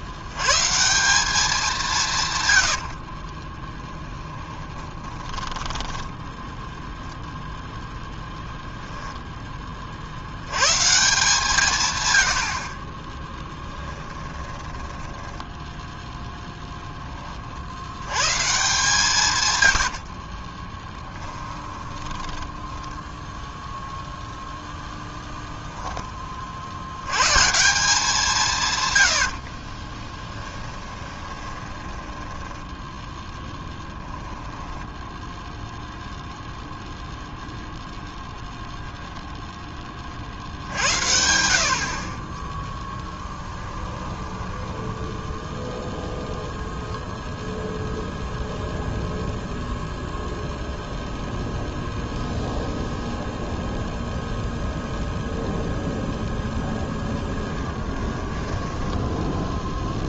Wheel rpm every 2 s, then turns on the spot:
140, 90, 20, 0, 10, 150, 50, 10, 10, 150, 20, 20, 0, 70, 140, 10, 10, 10, 0, 0, 70, 10, 10, 0, 0, 0, 0, 0, 0, 10.
2-6 14-16 20-24 30-32 34-36 42-46 58-60